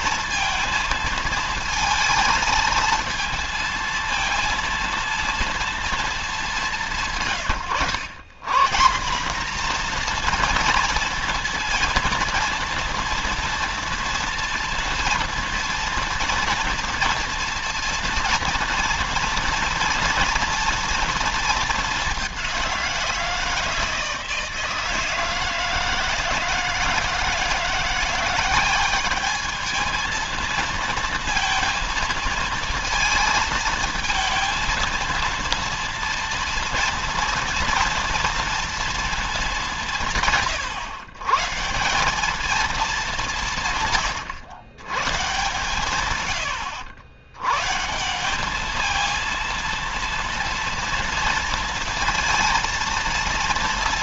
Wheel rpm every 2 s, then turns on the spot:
220, 220, 230, 200, 150, 230, 230, 230, 240, 230, 230, 190, 160, 160, 190, 230, 230, 230, 230, 230, 130, 210, 120, 120, 210, 230, 230.
none